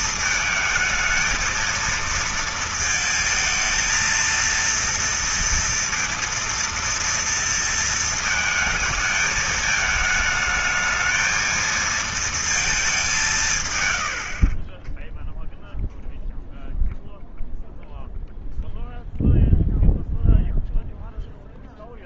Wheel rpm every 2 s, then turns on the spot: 220, 230, 230, 230, 220, 220, 220, 50, 0, 0, 0.
none